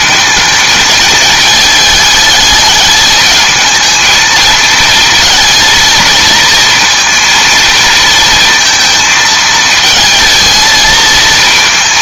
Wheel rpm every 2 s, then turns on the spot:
220, 210, 220, 230, 220, 220.
none